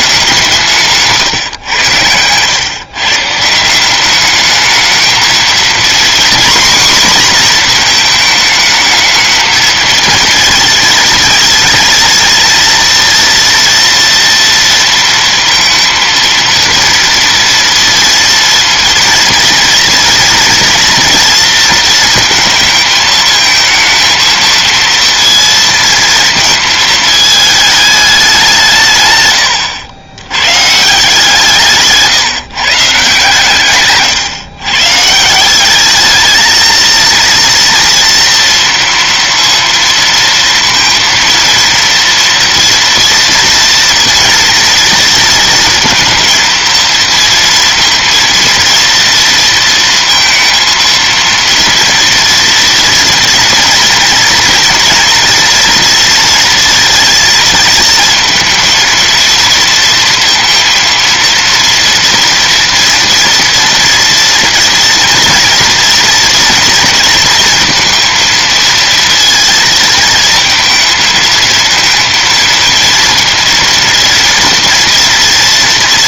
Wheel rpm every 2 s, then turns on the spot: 170, 140, 220, 250, 220, 230, 230, 230, 230, 230, 230, 220, 230, 220, 160, 140, 160, 140, 230, 230, 230, 230, 230, 230, 230, 230, 230, 230, 230, 230, 230, 230, 230, 230, 230, 230, 230, 240.
none